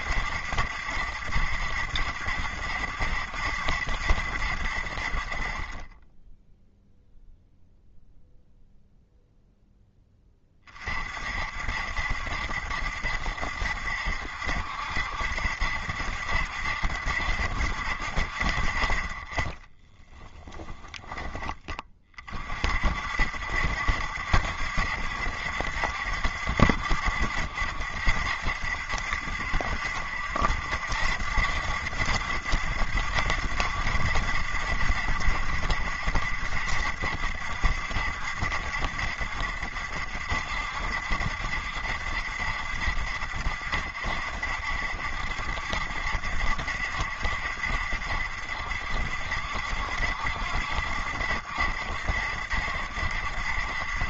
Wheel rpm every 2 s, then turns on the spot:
70, 70, 60, 0, 0, 30, 70, 70, 70, 60, 20, 50, 70, 70, 70, 80, 80, 70, 60, 70, 60, 70, 60, 70, 70, 70, 70.
20-22